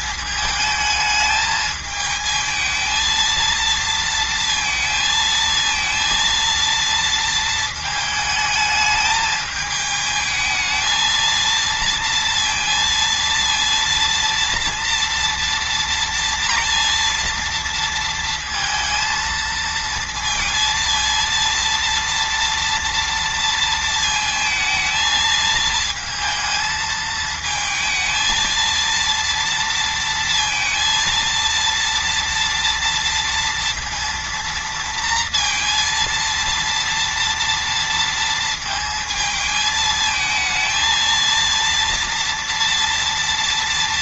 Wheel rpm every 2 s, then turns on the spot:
220, 220, 230, 230, 220, 220, 230, 230, 230, 230, 230, 230, 220, 220, 230, 230, 230, 230, 230, 220, 220, 230.
none